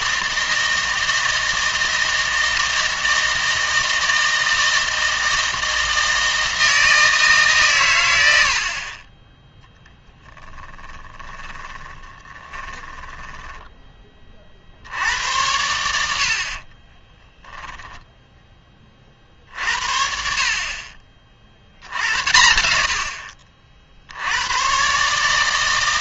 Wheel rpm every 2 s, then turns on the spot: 160, 160, 160, 160, 50, 20, 20, 70, 30, 20, 40, 70, 130.
10-14 16-18